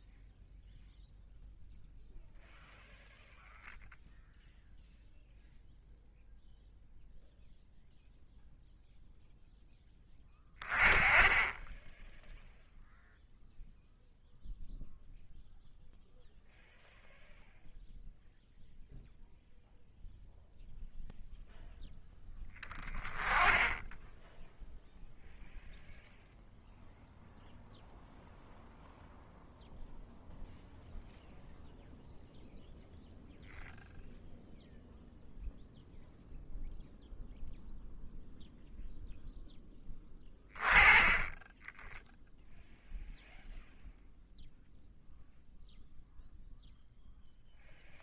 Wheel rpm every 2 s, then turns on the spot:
0, 0, 0, 0, 0, 20, 0, 0, 0, 0, 0, 10, 0, 0, 0, 0, 0, 0, 0, 0, 10, 0, 0, 0.
none